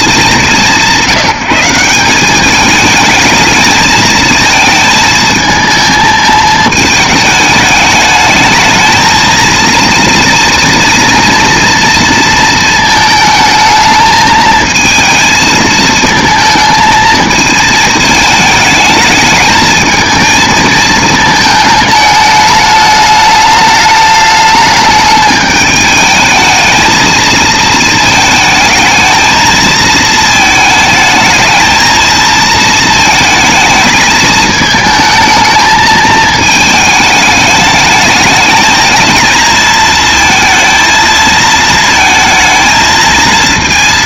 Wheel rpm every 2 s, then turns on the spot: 180, 220, 220, 210, 220, 230, 220, 220, 220, 220, 220, 210, 210, 220, 220, 220, 220, 220, 220, 220, 220, 220.
none